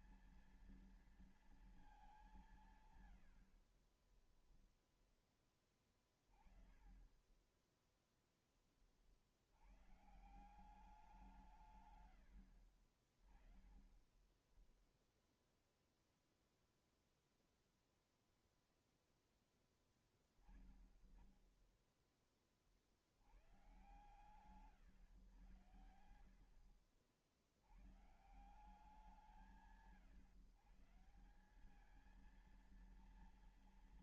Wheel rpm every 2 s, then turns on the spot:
230, 170, 10, 30, 10, 160, 90, 10, 0, 0, 10, 30, 130, 60, 150, 140, 220.
4-6 12-14